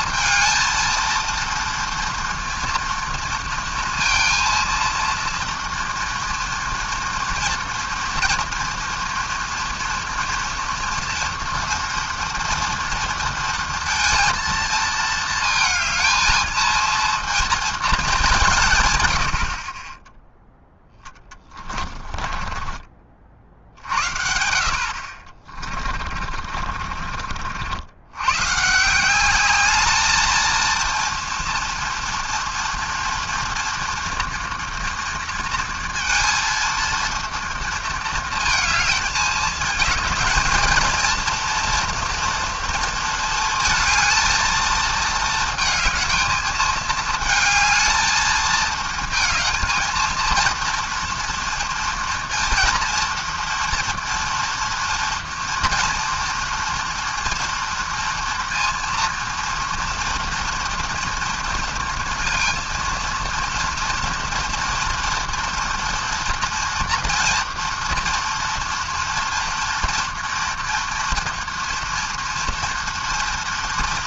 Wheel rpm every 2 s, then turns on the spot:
230, 230, 230, 240, 230, 230, 230, 230, 220, 150, 0, 30, 60, 40, 140, 230, 240, 230, 230, 230, 230, 230, 220, 220, 220, 230, 230, 240, 230, 230, 230, 230, 230, 230, 240, 230, 230.
22-24 26-28